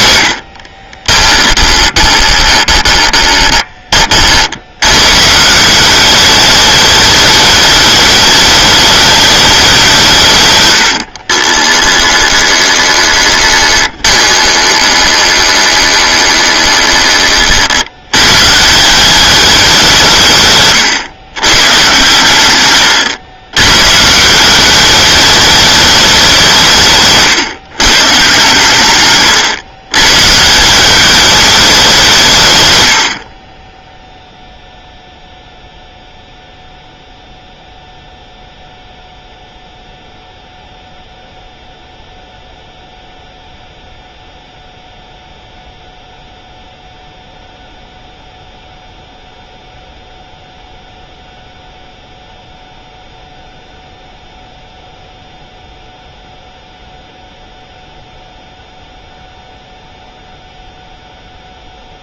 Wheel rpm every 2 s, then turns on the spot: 30, 20, 110, 210, 210, 80, 20, 20, 20, 180, 130, 110, 200, 150, 120, 190, 100, 0, 0, 0, 0, 0, 0, 0, 0, 0, 0, 0, 0, 0, 0.
0-4 10-16 20-22